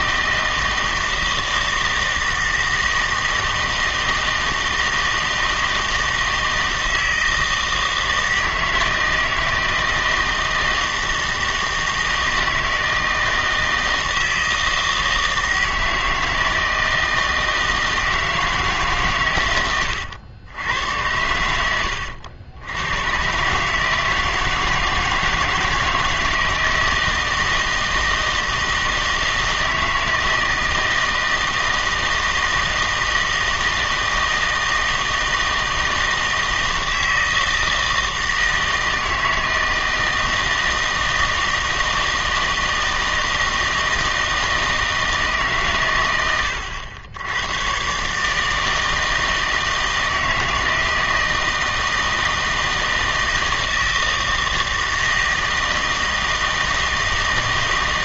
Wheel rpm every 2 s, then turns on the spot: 160, 160, 160, 160, 160, 160, 160, 160, 160, 150, 100, 100, 160, 160, 160, 160, 160, 160, 160, 160, 160, 160, 160, 100, 160, 160, 160, 160, 160.
none